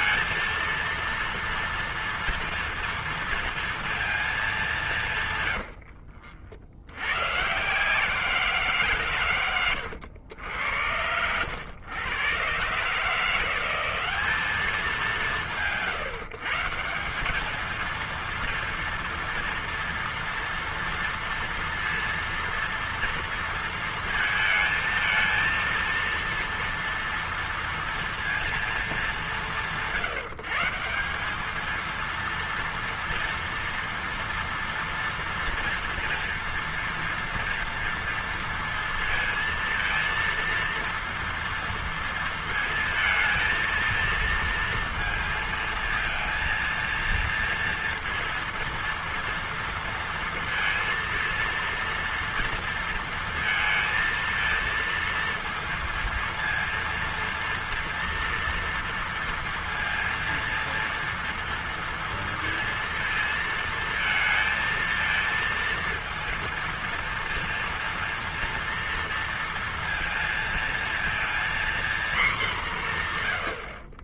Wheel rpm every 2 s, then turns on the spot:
230, 230, 200, 80, 160, 90, 130, 170, 160, 230, 230, 230, 230, 230, 220, 170, 230, 230, 230, 230, 230, 230, 230, 230, 230, 230, 230, 230, 230, 230, 230, 230, 230, 230, 230, 230, 200.
none